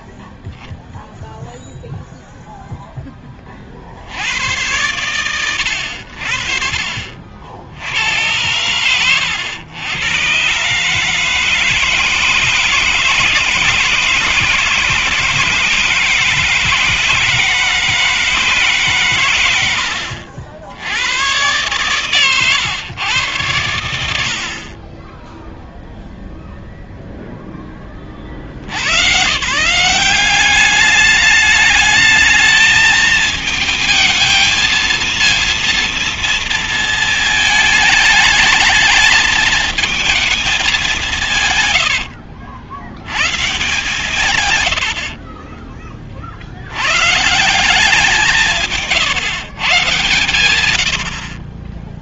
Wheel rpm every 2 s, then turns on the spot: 20, 0, 90, 70, 100, 150, 160, 150, 160, 150, 70, 120, 50, 0, 70, 200, 220, 220, 220, 220, 210, 80, 100, 90, 160, 90.
48-50